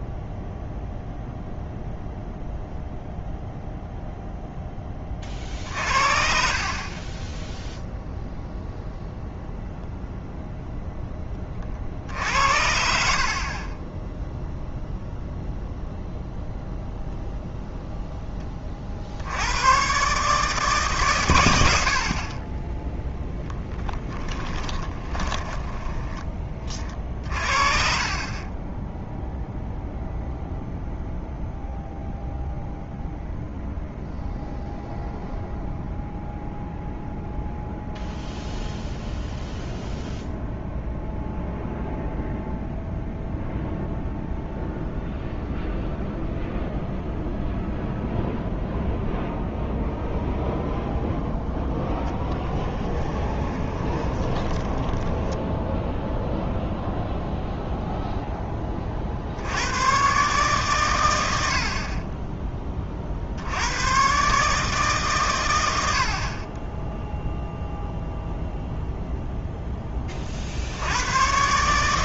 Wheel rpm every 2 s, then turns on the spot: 0, 0, 10, 40, 0, 10, 60, 0, 0, 40, 130, 10, 20, 30, 10, 0, 0, 0, 0, 0, 0, 0, 0, 0, 0, 0, 20, 20, 0, 20, 130, 20, 140, 30, 0, 60.
24-26 52-56